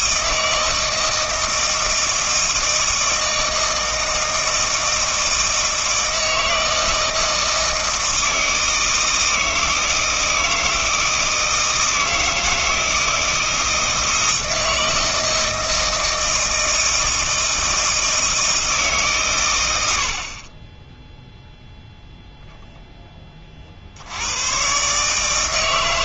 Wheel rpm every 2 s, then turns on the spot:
160, 160, 160, 160, 160, 160, 160, 160, 160, 160, 10, 0, 140.
none